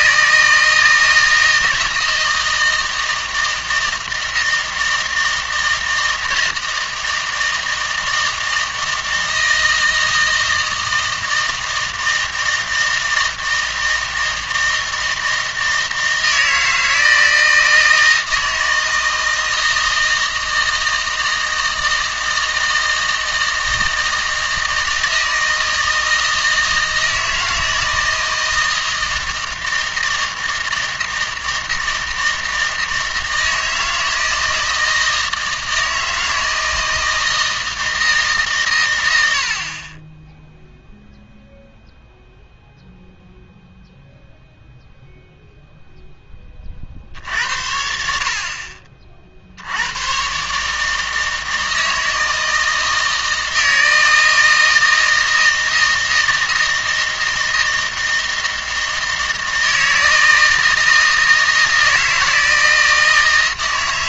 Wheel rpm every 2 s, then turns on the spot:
160, 160, 160, 160, 160, 160, 160, 160, 160, 160, 160, 160, 160, 160, 160, 160, 160, 160, 160, 120, 0, 0, 0, 40, 40, 150, 160, 160, 160, 160, 160, 160.
none